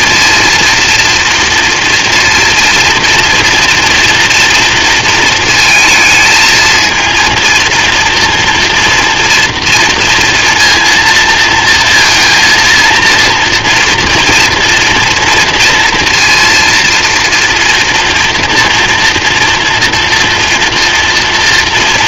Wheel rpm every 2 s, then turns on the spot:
230, 230, 230, 220, 240, 230, 230, 230, 230, 230, 230.
none